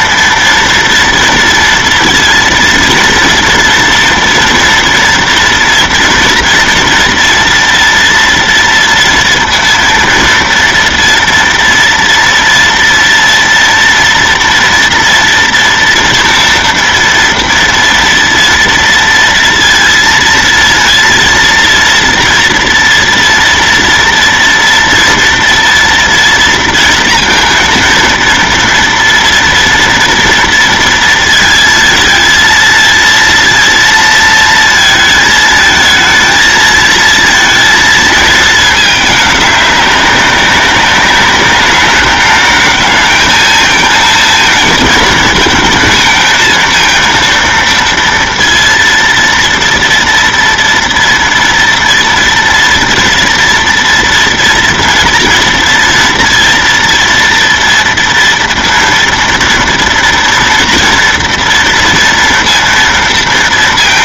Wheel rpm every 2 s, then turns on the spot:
230, 230, 230, 230, 230, 230, 230, 230, 230, 230, 230, 230, 230, 230, 230, 230, 230, 230, 230, 220, 190, 220, 230, 230, 230, 230, 230, 230, 230, 230, 230, 230.
none